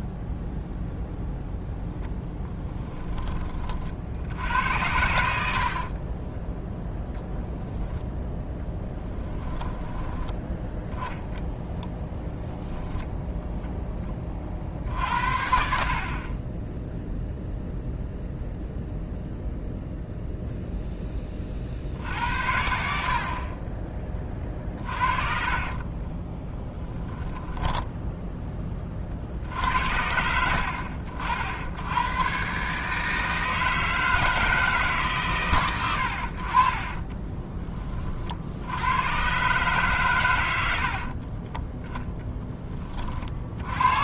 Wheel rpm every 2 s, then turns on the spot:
0, 10, 80, 10, 10, 10, 0, 50, 20, 0, 0, 70, 40, 10, 20, 60, 140, 160, 40, 70, 80, 10.
8-10 24-28 40-42